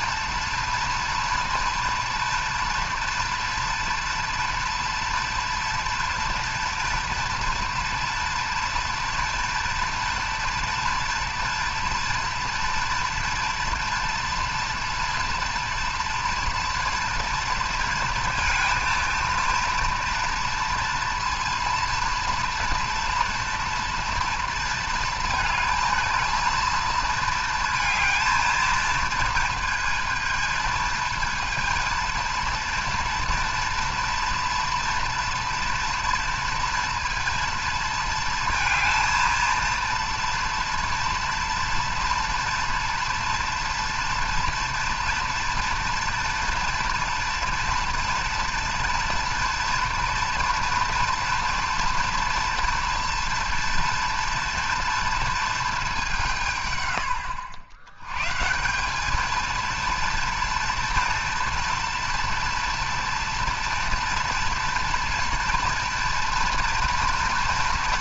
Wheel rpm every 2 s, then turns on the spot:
230, 230, 230, 230, 230, 230, 240, 230, 230, 230, 230, 230, 230, 230, 220, 220, 230, 230, 230, 230, 230, 230, 230, 240, 230, 230, 230, 230, 110, 180, 230, 230, 230, 240.
none